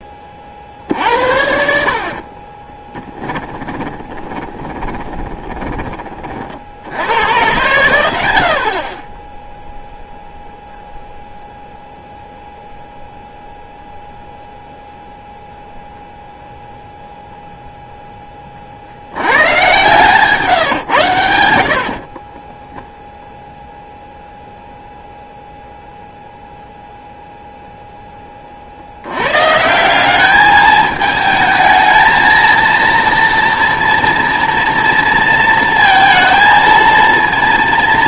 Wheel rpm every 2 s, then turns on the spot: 50, 20, 20, 70, 50, 0, 0, 0, 0, 40, 140, 10, 0, 0, 70, 210, 230, 230, 230.
2-6 22-24